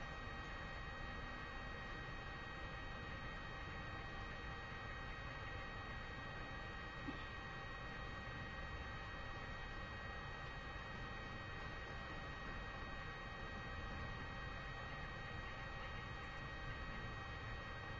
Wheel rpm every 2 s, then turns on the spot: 0, 0, 0, 0, 0, 0, 0, 0, 0.
none